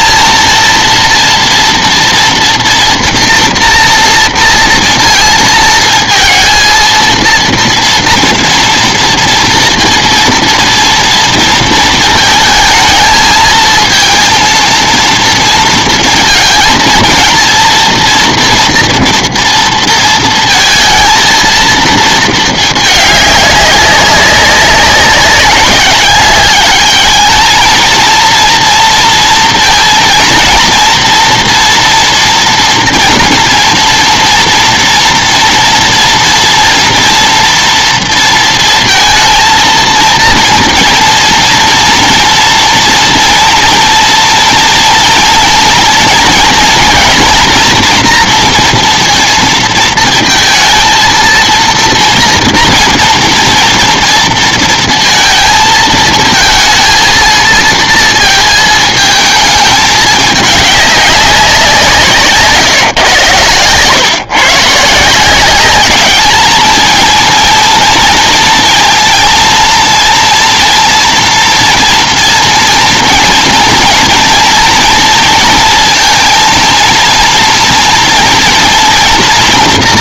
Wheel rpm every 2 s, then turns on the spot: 230, 230, 240, 230, 230, 230, 230, 230, 220, 230, 220, 210, 190, 210, 230, 230, 230, 240, 230, 230, 230, 230, 230, 230, 240, 230, 230, 230, 230, 230, 210, 150, 150, 220, 230, 230, 230, 230, 230, 230.
62-64